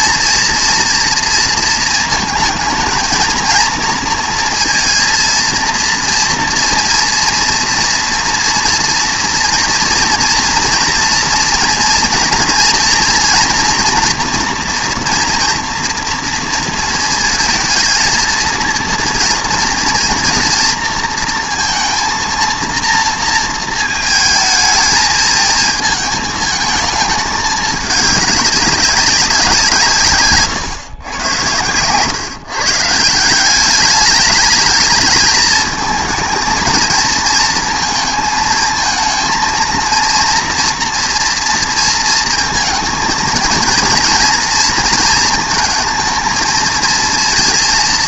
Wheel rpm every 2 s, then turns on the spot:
230, 220, 230, 230, 230, 230, 230, 230, 230, 220, 230, 230, 220, 220, 200, 120, 150, 220, 230, 230, 230, 230, 230, 220.
none